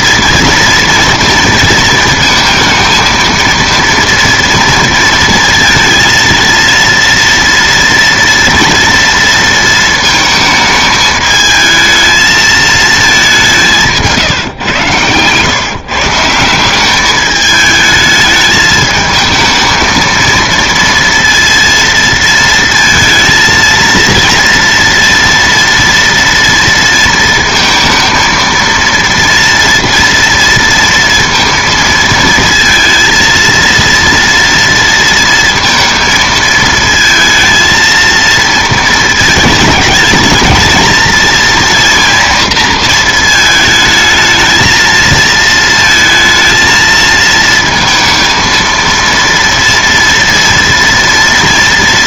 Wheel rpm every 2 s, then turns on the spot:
230, 230, 230, 230, 230, 220, 220, 120, 190, 220, 230, 230, 230, 230, 230, 230, 230, 230, 220, 230, 220, 230, 220, 230, 230, 230.
none